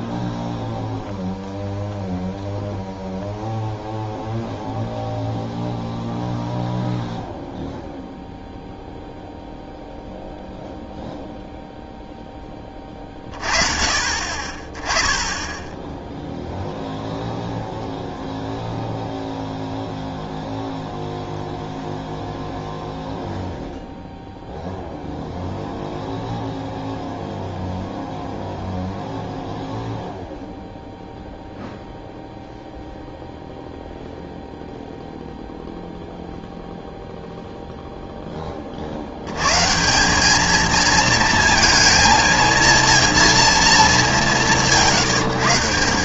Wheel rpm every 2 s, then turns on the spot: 0, 0, 0, 0, 0, 0, 20, 20, 0, 0, 0, 0, 0, 0, 0, 0, 0, 0, 0, 60, 230, 230, 120.
none